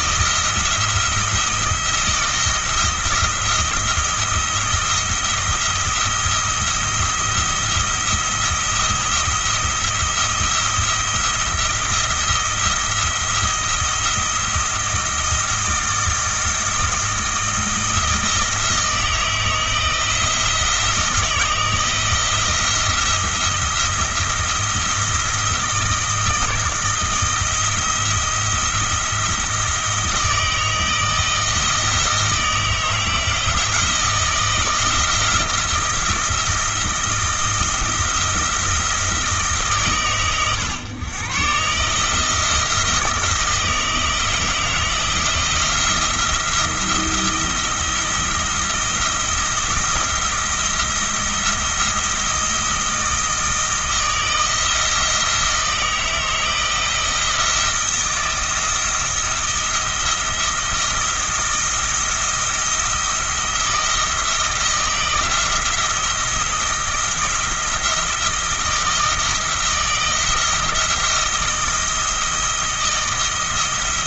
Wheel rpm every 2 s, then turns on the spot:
170, 170, 170, 170, 170, 170, 170, 170, 160, 160, 160, 170, 170, 160, 170, 160, 160, 170, 170, 170, 120, 160, 160, 170, 170, 170, 160, 160, 160, 170, 170, 170, 170, 170, 160, 160, 170.
none